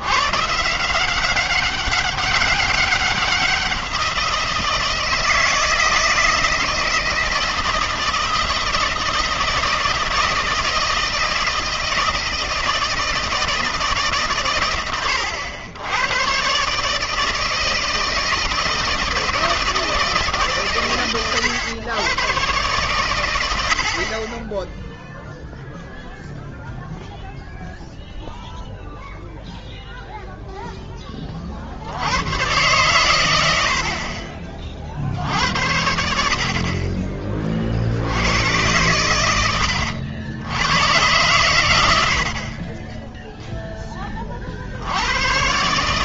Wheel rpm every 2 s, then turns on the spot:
160, 190, 160, 160, 160, 160, 160, 110, 130, 160, 140, 120, 10, 0, 0, 0, 120, 30, 40, 110, 100, 20, 40.
42-44